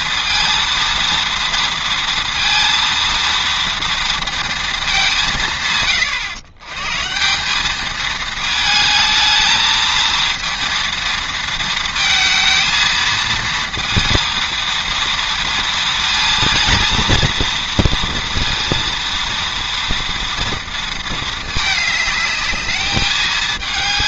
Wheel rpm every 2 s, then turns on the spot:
230, 230, 220, 120, 220, 230, 220, 230, 230, 230, 230, 210.
none